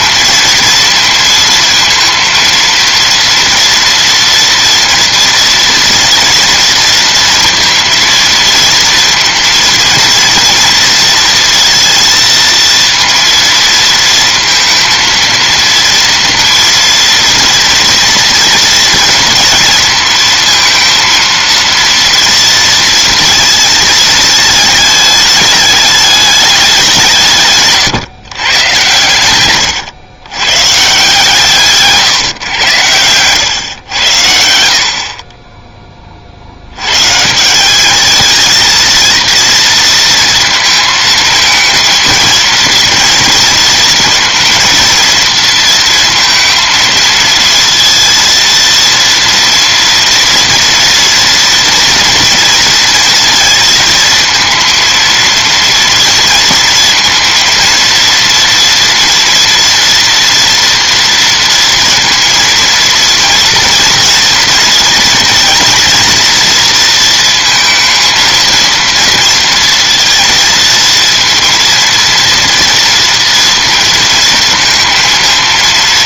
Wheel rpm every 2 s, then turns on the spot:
230, 230, 240, 230, 230, 230, 230, 230, 230, 230, 230, 230, 210, 190, 120, 140, 120, 70, 90, 230, 230, 230, 230, 230, 230, 240, 230, 230, 230, 230, 230, 230, 230, 230, 230, 230, 230, 230.
none